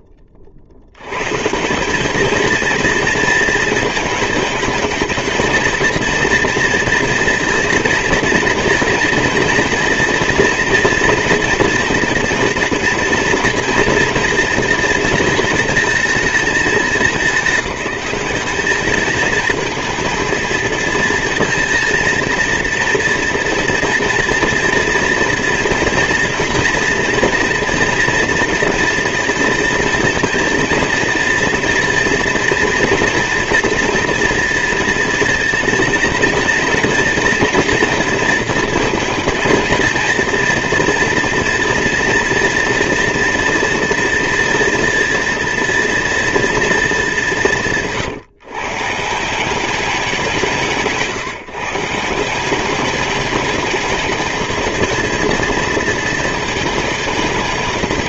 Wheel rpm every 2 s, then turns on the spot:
80, 230, 220, 230, 230, 230, 230, 230, 210, 210, 220, 230, 230, 240, 240, 230, 230, 230, 230, 230, 240, 230, 240, 210, 170, 160, 210, 230, 220.
none